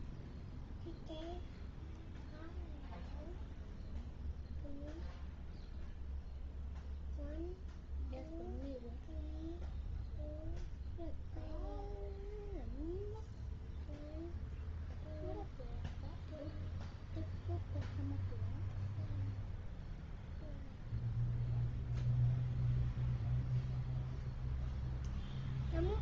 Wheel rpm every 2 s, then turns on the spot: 0, 0, 0, 0, 0, 0, 0, 0, 0, 0, 0, 0, 0.
none